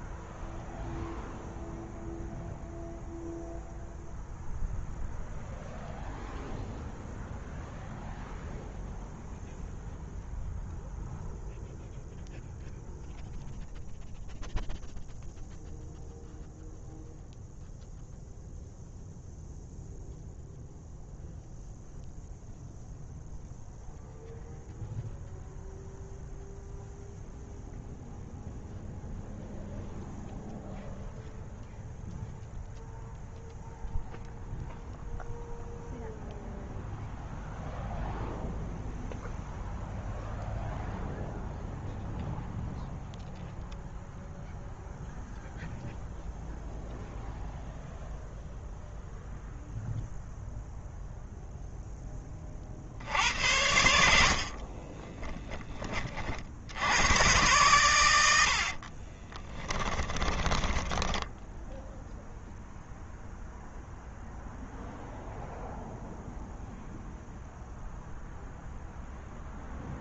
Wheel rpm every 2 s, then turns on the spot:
0, 0, 0, 0, 0, 0, 0, 0, 0, 0, 0, 0, 0, 0, 0, 0, 0, 0, 0, 0, 0, 0, 0, 0, 0, 0, 60, 30, 90, 40, 10, 0, 0, 0, 0.
54-56 58-62